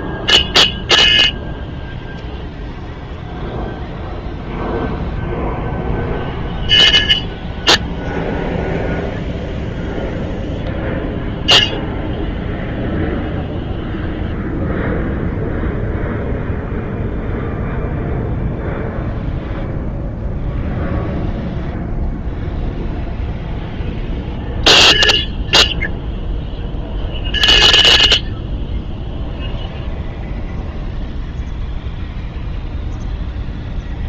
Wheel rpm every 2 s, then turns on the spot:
0, 0, 0, 0, 0, 0, 0, 0, 0, 0, 0, 0, 0, 0, 0, 0, 0.
none